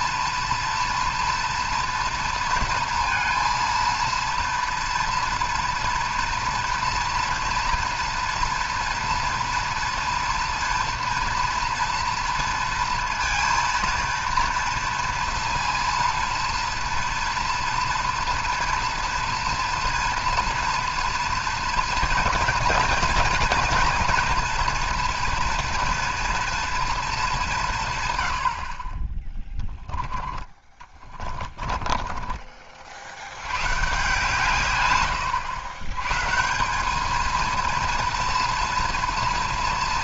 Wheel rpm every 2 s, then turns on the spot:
230, 230, 230, 230, 230, 230, 230, 230, 230, 230, 230, 230, 240, 230, 60, 20, 50, 120, 190, 230.
30-32